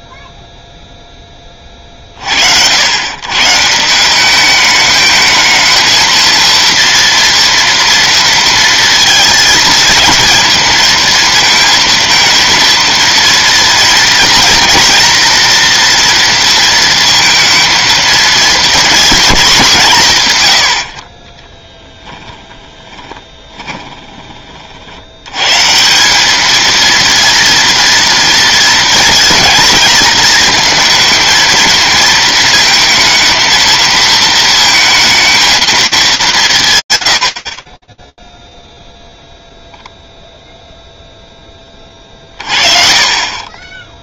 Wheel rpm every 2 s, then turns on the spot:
0, 80, 210, 230, 230, 230, 230, 240, 230, 230, 110, 10, 50, 220, 230, 230, 220, 220, 170, 0, 0, 40.
20-24